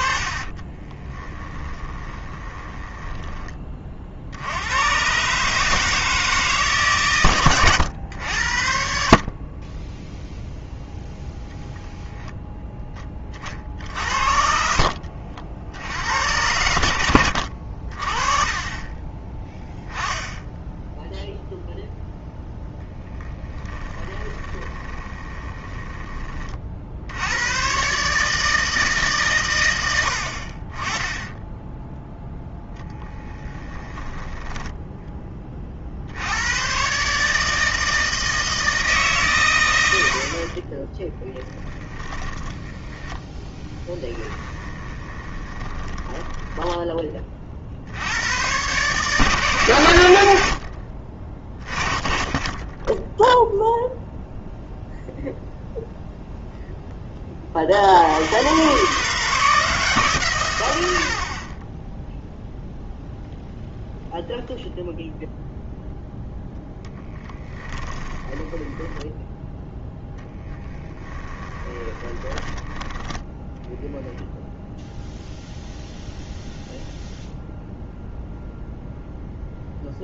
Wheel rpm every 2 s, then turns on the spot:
20, 10, 110, 140, 60, 0, 10, 60, 90, 20, 0, 0, 20, 60, 150, 30, 0, 10, 130, 160, 20, 10, 20, 10, 140, 50, 10, 0, 10, 130, 90, 0, 0, 10, 20, 10, 10, 0, 0, 0.
0-4 14-18 24-26 44-46 66-74